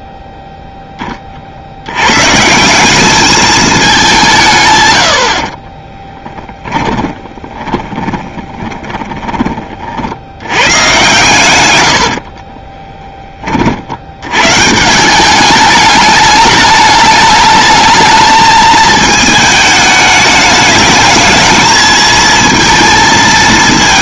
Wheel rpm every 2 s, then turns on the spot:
10, 180, 130, 20, 20, 110, 40, 150, 210, 220, 210, 230.
6-10 12-14